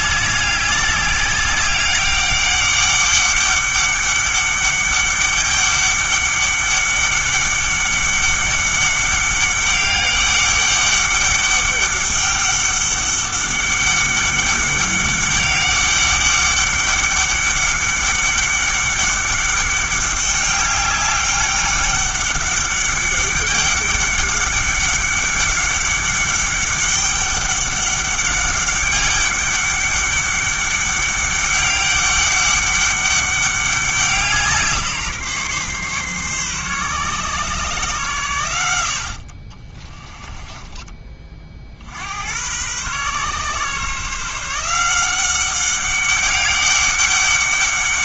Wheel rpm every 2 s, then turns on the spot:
200, 200, 200, 200, 200, 200, 200, 200, 200, 200, 200, 200, 200, 200, 200, 200, 200, 160, 140, 80, 20, 120, 170, 200.
none